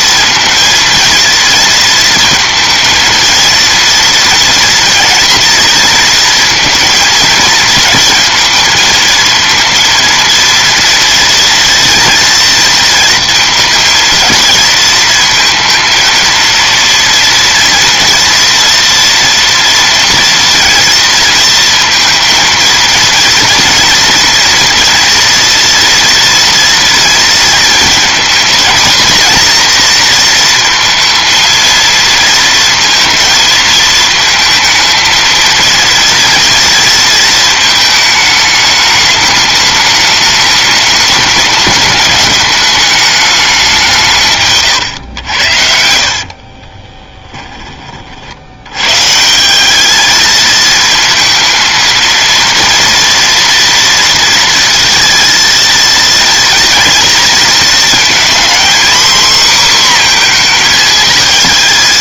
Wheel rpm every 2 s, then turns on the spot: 230, 230, 240, 220, 220, 230, 230, 230, 230, 240, 230, 230, 240, 230, 230, 230, 230, 230, 230, 210, 210, 210, 140, 30, 100, 220, 230, 230, 230, 240, 230.
44-48